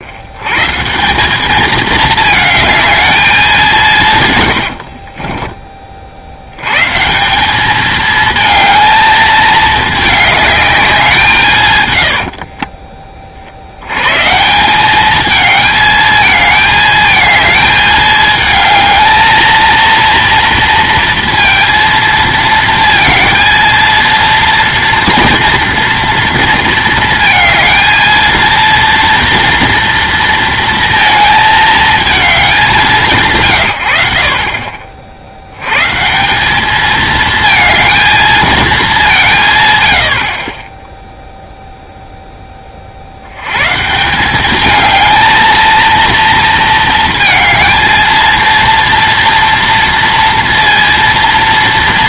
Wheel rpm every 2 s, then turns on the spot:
130, 220, 80, 120, 220, 200, 30, 180, 220, 220, 230, 230, 230, 230, 230, 230, 190, 50, 210, 210, 10, 30, 210, 230, 230, 230.
4-6 12-14